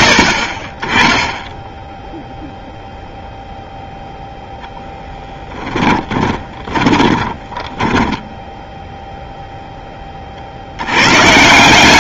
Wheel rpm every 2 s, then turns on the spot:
40, 0, 0, 20, 0, 90.
6-8